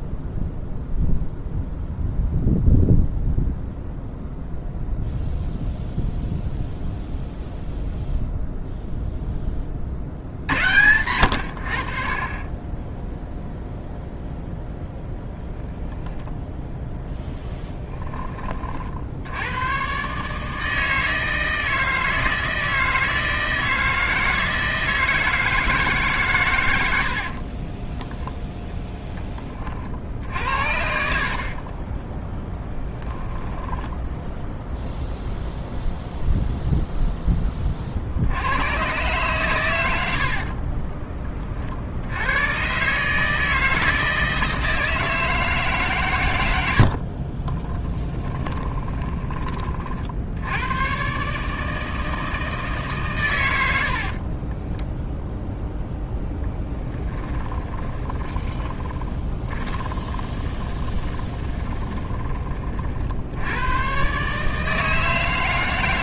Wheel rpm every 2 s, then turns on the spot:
0, 0, 0, 0, 0, 90, 20, 0, 0, 40, 160, 160, 160, 100, 10, 60, 10, 0, 0, 100, 30, 120, 160, 80, 20, 100, 160, 20, 20, 20, 20, 30, 150.
40-42 46-50 54-62